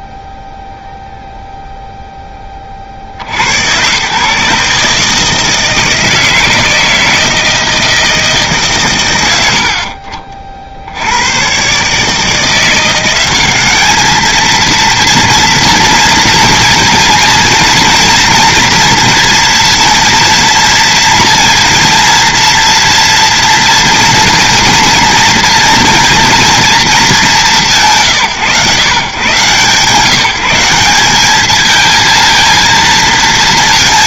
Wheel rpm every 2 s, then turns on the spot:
0, 30, 140, 160, 120, 70, 170, 230, 230, 230, 230, 230, 230, 230, 130, 180, 230.
none